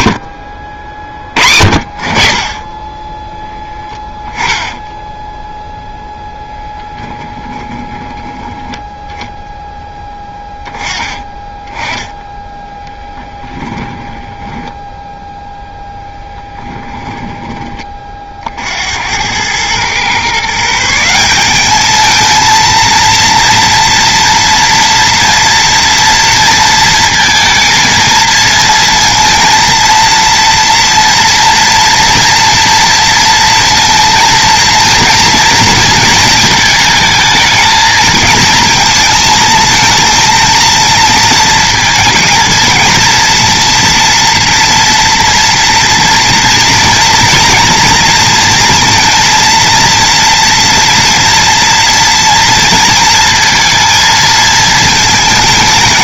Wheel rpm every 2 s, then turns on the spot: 50, 30, 10, 10, 10, 10, 10, 10, 10, 60, 160, 230, 230, 220, 230, 230, 230, 230, 220, 230, 230, 230, 230, 230, 230, 240, 230, 220.
4-6 16-18